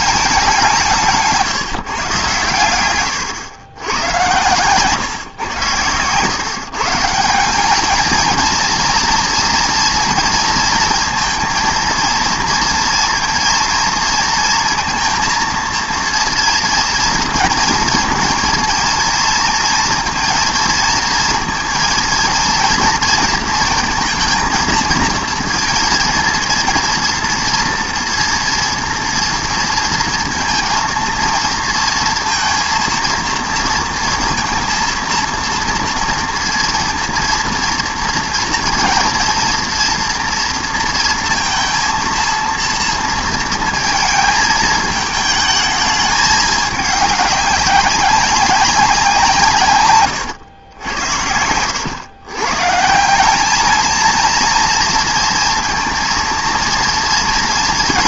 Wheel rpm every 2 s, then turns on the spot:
180, 110, 110, 140, 230, 230, 230, 230, 230, 230, 230, 230, 230, 230, 230, 230, 230, 230, 230, 230, 230, 230, 220, 210, 200, 100, 140, 230, 230.
none